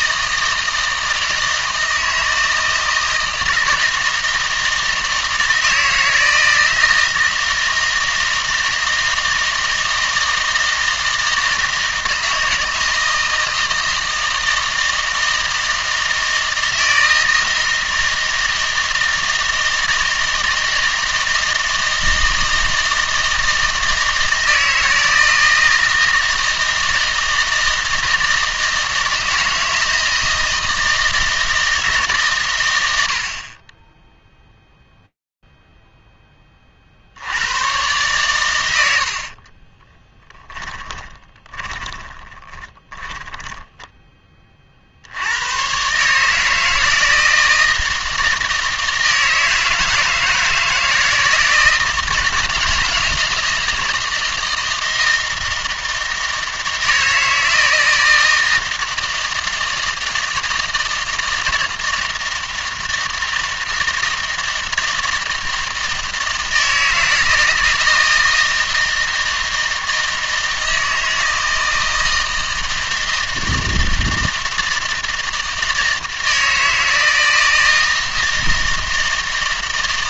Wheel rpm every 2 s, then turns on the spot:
160, 160, 160, 160, 160, 160, 160, 160, 160, 160, 160, 160, 160, 160, 160, 160, 120, 0, 40, 110, 10, 20, 50, 160, 160, 160, 160, 160, 160, 160, 160, 160, 160, 160, 160, 160, 160, 160, 160, 160.
40-44